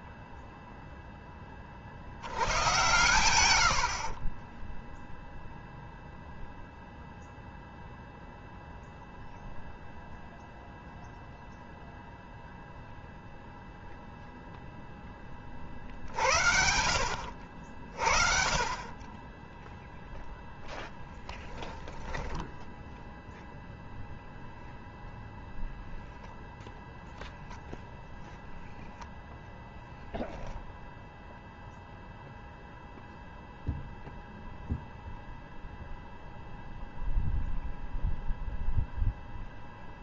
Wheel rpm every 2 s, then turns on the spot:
0, 100, 0, 0, 0, 0, 0, 0, 60, 30, 0, 0, 10, 0, 0, 0, 0, 0, 0, 0.
none